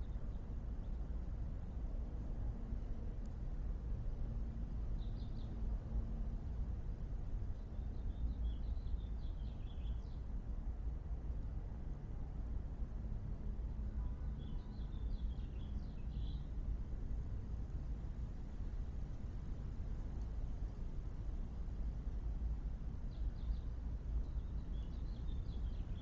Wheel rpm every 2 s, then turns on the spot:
0, 0, 0, 0, 0, 0, 0, 0, 0, 0, 0, 0, 0.
none